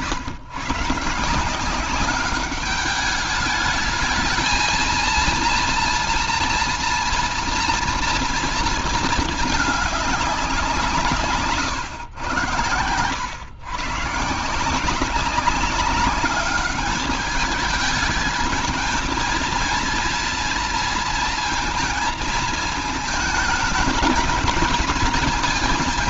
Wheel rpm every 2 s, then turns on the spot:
130, 200, 220, 240, 230, 190, 110, 150, 200, 220, 230, 220, 220.
none